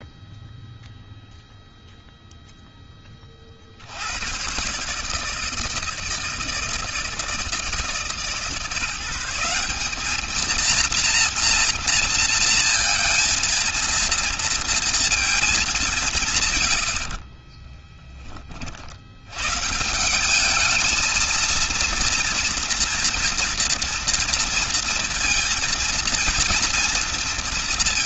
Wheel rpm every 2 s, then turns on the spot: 0, 10, 140, 160, 150, 230, 230, 230, 110, 50, 210, 230, 230, 230.
16-18